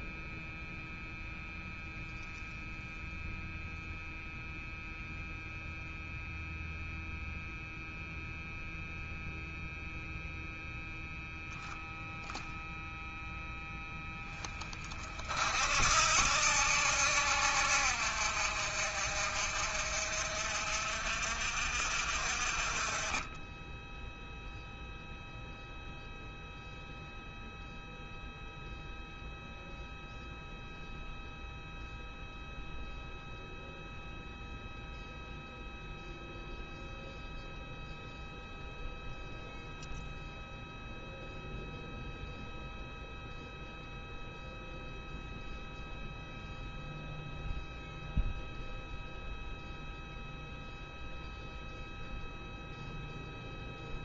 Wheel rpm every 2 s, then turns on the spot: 0, 0, 0, 0, 0, 0, 0, 30, 70, 50, 60, 40, 0, 0, 0, 0, 0, 0, 0, 0, 0, 0, 0, 0, 0, 0, 0.
none